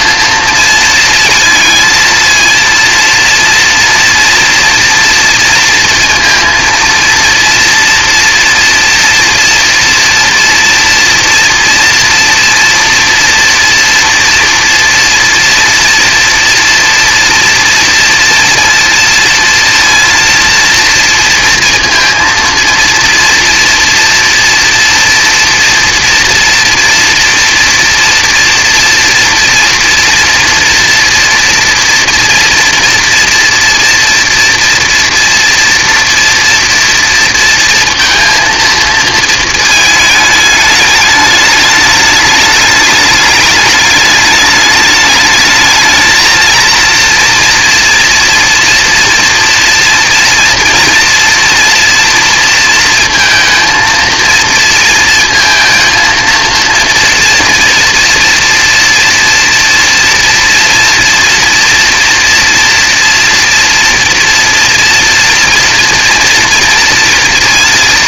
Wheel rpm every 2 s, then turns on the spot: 230, 230, 230, 230, 230, 230, 230, 230, 230, 230, 230, 230, 230, 230, 230, 230, 230, 230, 230, 230, 210, 200, 210, 230, 230, 240, 230, 230, 230, 230, 230, 230, 240, 240.
none